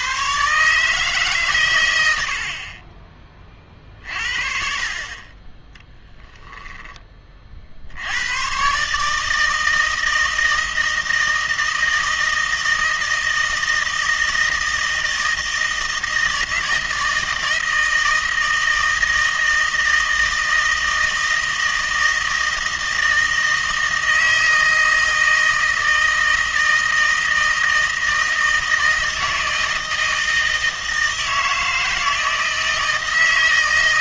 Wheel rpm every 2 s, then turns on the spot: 150, 40, 50, 10, 130, 160, 160, 160, 160, 160, 160, 160, 160, 160, 160, 160, 160.
none